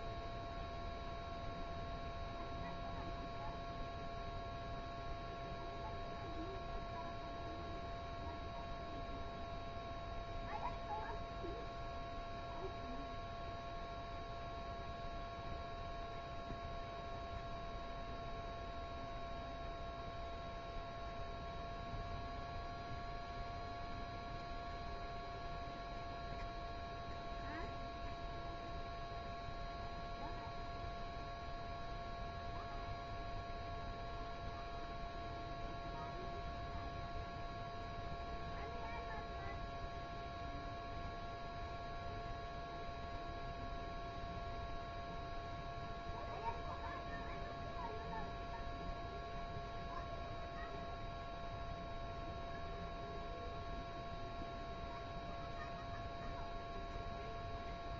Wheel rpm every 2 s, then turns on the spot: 0, 0, 0, 0, 0, 0, 0, 0, 0, 0, 0, 0, 0, 0, 0, 0, 0, 0, 0, 0, 0, 0, 0, 0, 0, 0, 0, 0, 0.
none